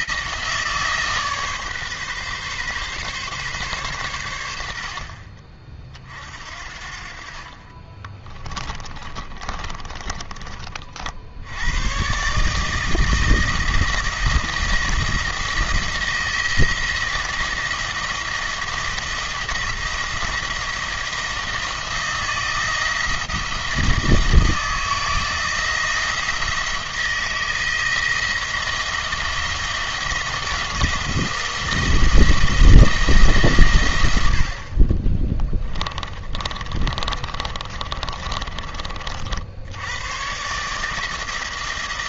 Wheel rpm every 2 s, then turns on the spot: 160, 140, 60, 50, 20, 40, 160, 170, 170, 170, 170, 170, 160, 170, 170, 170, 160, 30, 30, 50, 160.
8-10 36-38